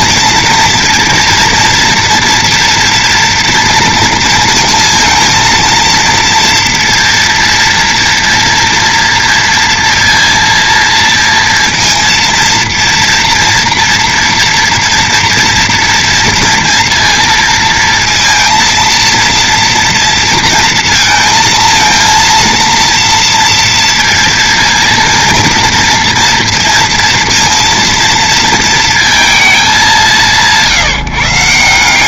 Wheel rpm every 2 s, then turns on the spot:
230, 230, 230, 230, 230, 230, 230, 230, 230, 230, 230, 230, 230, 230, 230, 170.
none